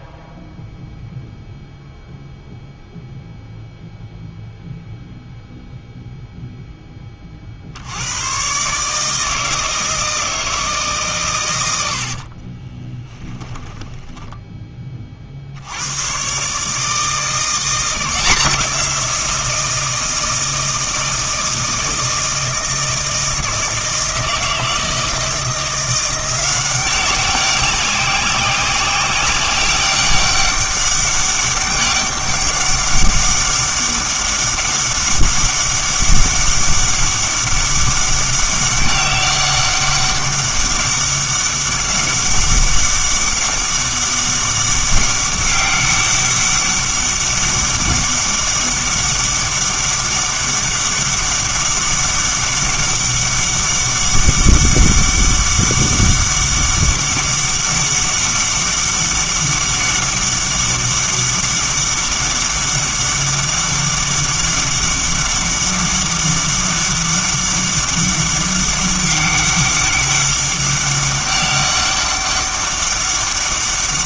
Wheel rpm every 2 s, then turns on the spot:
0, 0, 0, 10, 140, 150, 20, 20, 150, 170, 160, 160, 160, 190, 190, 200, 200, 200, 200, 200, 200, 200, 200, 200, 200, 200, 200, 200, 200, 200, 200, 200, 200, 200, 200, 200, 200.
12-14